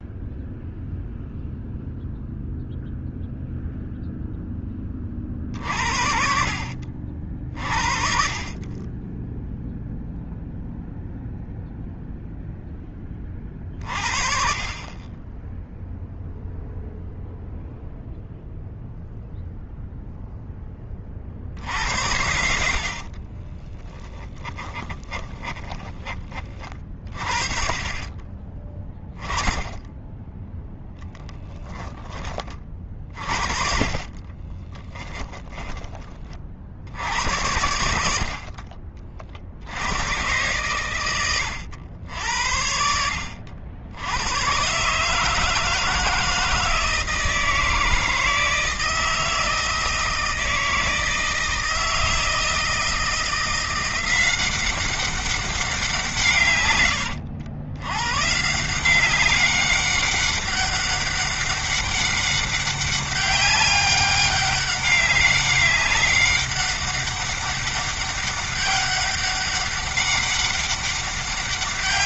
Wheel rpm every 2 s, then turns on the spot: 0, 0, 30, 50, 20, 0, 30, 20, 0, 0, 40, 50, 20, 40, 20, 10, 40, 20, 90, 40, 110, 70, 150, 160, 160, 160, 170, 190, 90, 180, 200, 200, 200, 200, 200, 200.
22-26 34-36